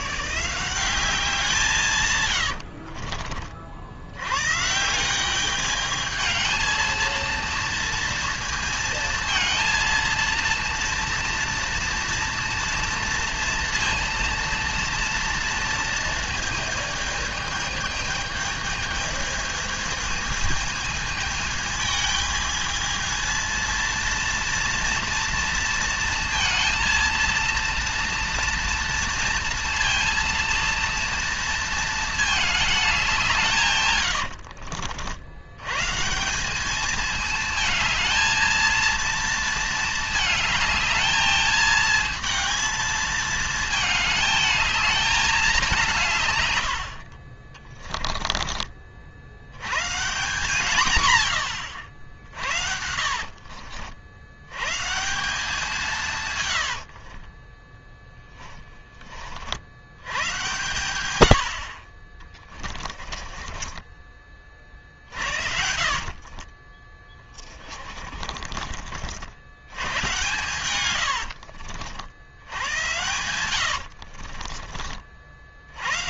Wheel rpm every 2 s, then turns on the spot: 180, 70, 160, 220, 230, 230, 230, 230, 220, 220, 220, 220, 230, 230, 230, 230, 200, 70, 210, 230, 220, 220, 210, 70, 40, 110, 50, 150, 70, 20, 90, 20, 30, 20, 50, 110, 110, 40.
2-4 34-36 52-54 56-58 62-68 70-74